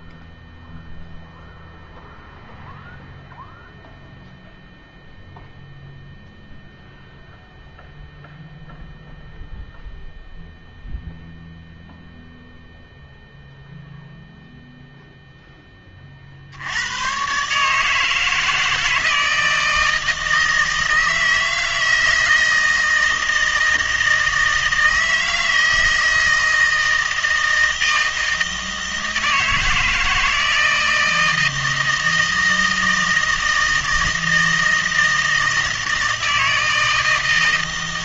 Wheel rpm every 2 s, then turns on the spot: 0, 0, 0, 0, 0, 0, 0, 0, 80, 160, 160, 160, 160, 160, 160, 160, 160, 160, 160.
none